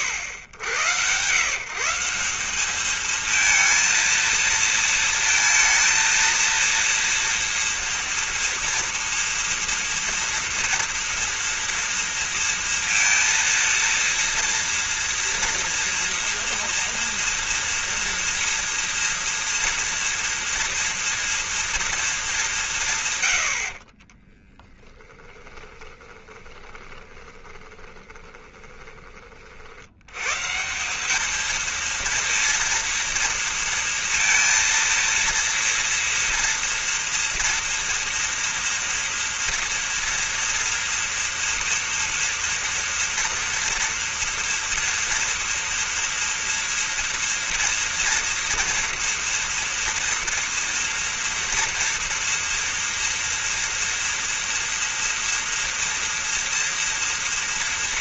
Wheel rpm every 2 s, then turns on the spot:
100, 200, 230, 230, 230, 230, 230, 230, 230, 230, 230, 170, 10, 20, 20, 170, 230, 230, 230, 230, 230, 230, 230, 230, 240, 230, 240, 240, 240.
24-30